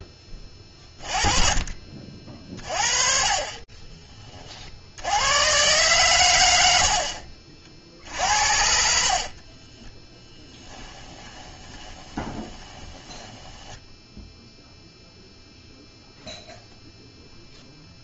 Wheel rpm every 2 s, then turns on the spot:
30, 40, 70, 90, 60, 10, 20, 0, 0.
8-14